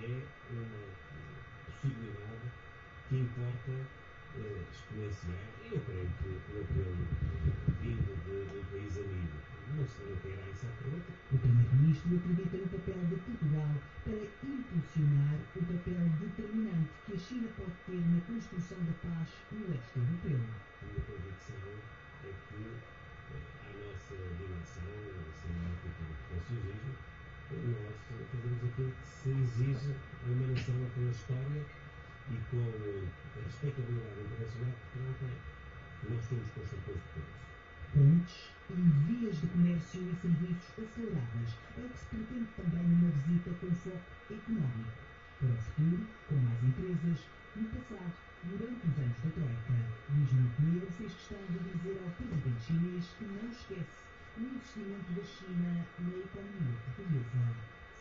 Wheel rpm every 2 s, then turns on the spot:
0, 0, 0, 0, 0, 0, 0, 0, 0, 0, 0, 0, 0, 0, 0, 0, 0, 0, 0, 0, 0, 0, 0, 0, 0, 0, 0, 0, 0.
none